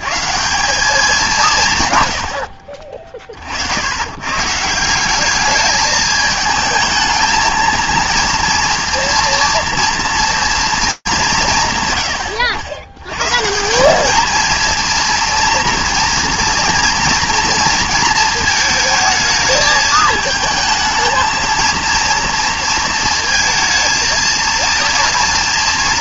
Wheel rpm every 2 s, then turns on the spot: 190, 50, 160, 220, 230, 200, 110, 230, 230, 220, 220, 230, 230.
none